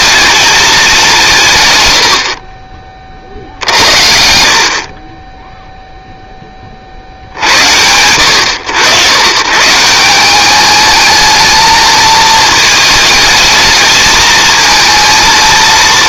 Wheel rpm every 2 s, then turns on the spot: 210, 40, 50, 30, 90, 210, 220, 220.
none